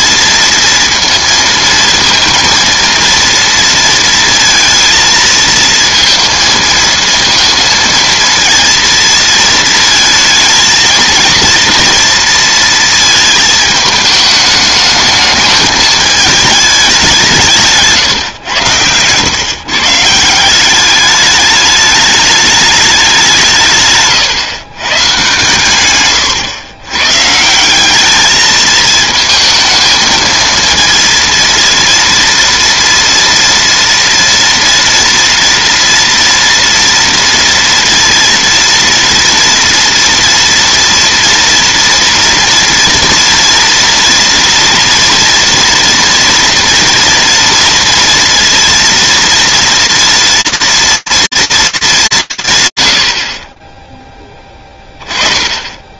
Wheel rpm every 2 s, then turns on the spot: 230, 230, 230, 230, 230, 220, 230, 220, 210, 110, 190, 210, 140, 120, 220, 230, 230, 230, 230, 230, 230, 230, 230, 240, 230, 240, 140, 20.
none